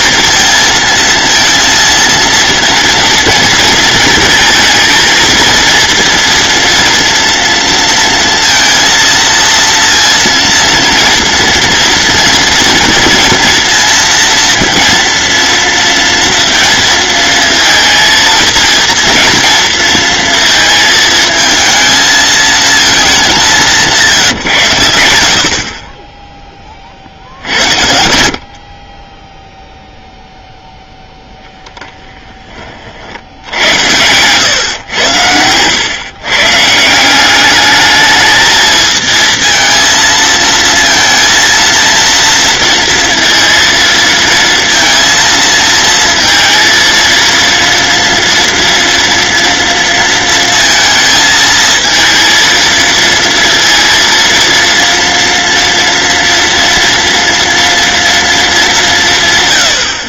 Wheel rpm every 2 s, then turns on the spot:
230, 230, 230, 230, 230, 230, 230, 230, 230, 230, 220, 200, 90, 40, 30, 0, 60, 100, 170, 220, 230, 230, 230, 230, 230, 230, 230, 230, 230, 180.
none